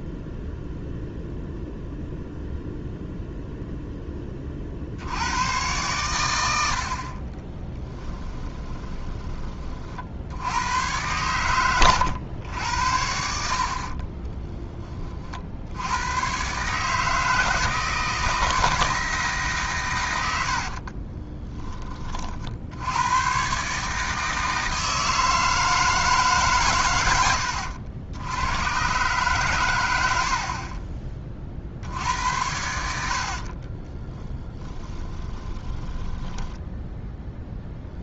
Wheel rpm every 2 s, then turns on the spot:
0, 0, 60, 60, 20, 90, 90, 10, 150, 160, 50, 80, 160, 130, 120, 30, 90, 20, 0.
8-10 20-22 34-36